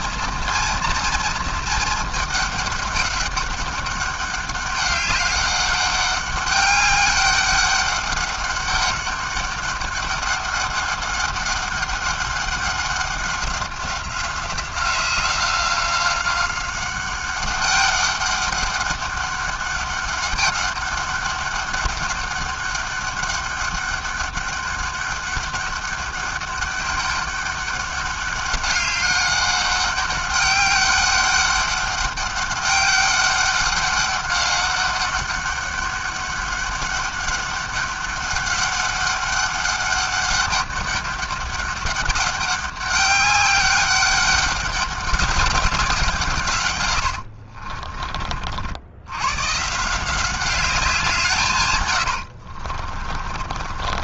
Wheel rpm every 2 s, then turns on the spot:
230, 210, 200, 200, 200, 200, 190, 180, 190, 200, 200, 200, 200, 200, 200, 200, 200, 200, 200, 200, 200, 200, 200, 100, 80, 180, 40.
46-48 52-54